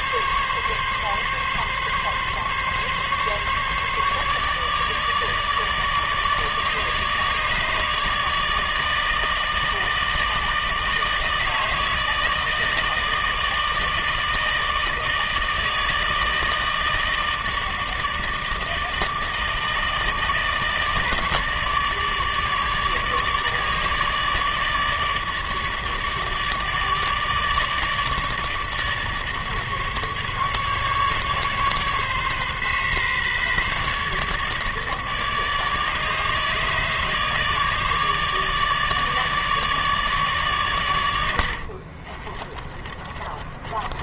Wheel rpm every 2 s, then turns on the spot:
140, 140, 150, 150, 160, 160, 160, 160, 160, 160, 150, 150, 150, 150, 150, 140, 140, 150, 150, 150, 110, 30.
42-44